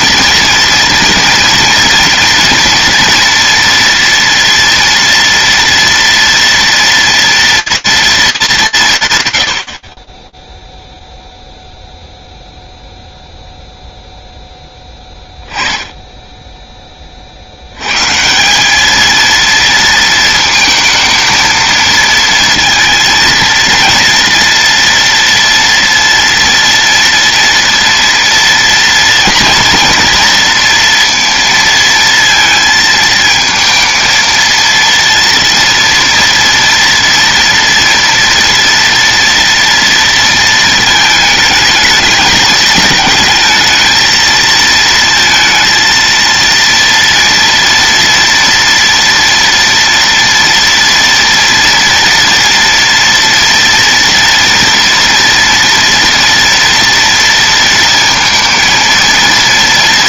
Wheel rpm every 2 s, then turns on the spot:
230, 230, 230, 230, 160, 0, 0, 10, 20, 210, 230, 230, 230, 230, 230, 230, 220, 230, 230, 230, 220, 220, 230, 230, 230, 230, 230, 230, 230, 230.
none